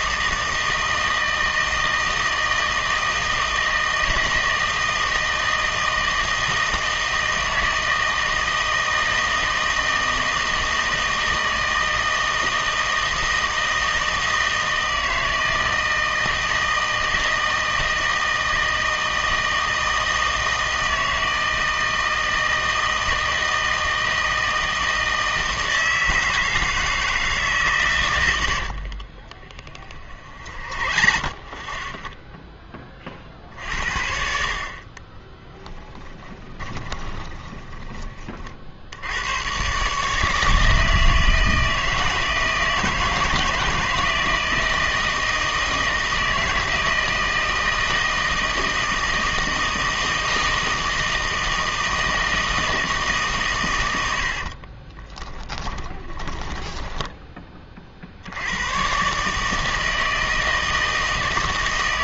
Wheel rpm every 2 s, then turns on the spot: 160, 160, 160, 160, 160, 160, 160, 160, 160, 160, 160, 160, 160, 160, 70, 40, 10, 50, 10, 50, 160, 160, 160, 160, 160, 160, 160, 30, 10, 100, 160.
28-32 36-38 54-58